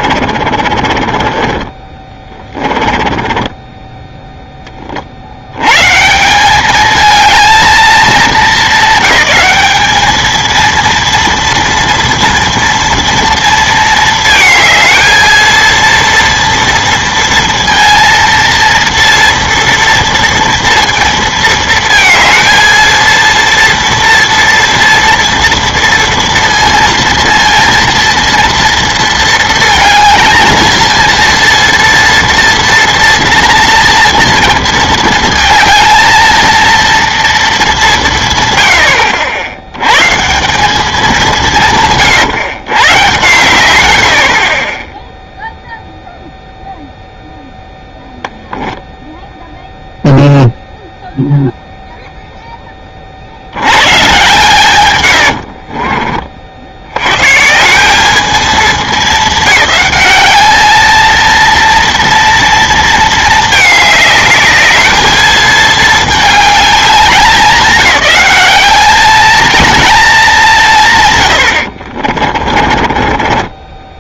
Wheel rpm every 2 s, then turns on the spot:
40, 20, 20, 200, 200, 230, 230, 220, 230, 230, 230, 230, 230, 230, 230, 230, 230, 230, 230, 110, 190, 130, 20, 0, 0, 0, 10, 130, 70, 210, 210, 230, 210, 200, 200, 170, 30.
0-4 72-74